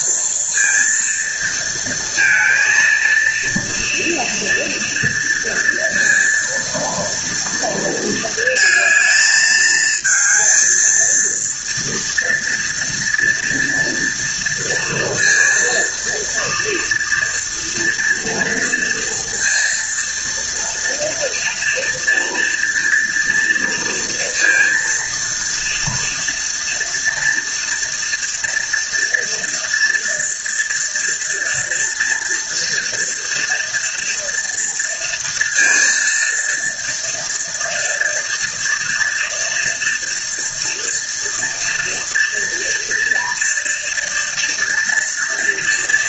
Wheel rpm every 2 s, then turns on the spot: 230, 230, 230, 230, 220, 230, 230, 230, 230, 230, 230, 230, 230, 240, 230, 230, 230, 230, 230, 230, 230, 230, 230.
none